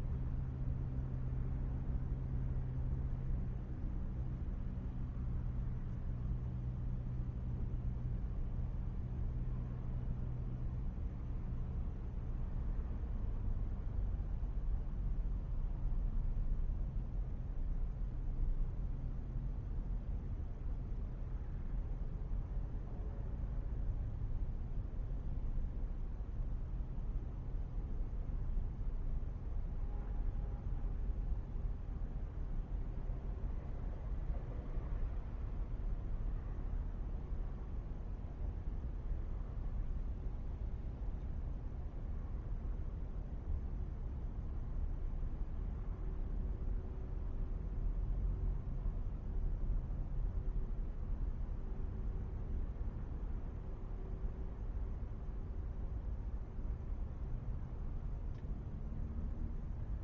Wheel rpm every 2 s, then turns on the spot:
0, 0, 0, 0, 0, 0, 0, 0, 0, 0, 0, 0, 0, 0, 0, 0, 0, 0, 0, 0, 0, 0, 0, 0, 0, 0, 0, 0, 0, 0.
none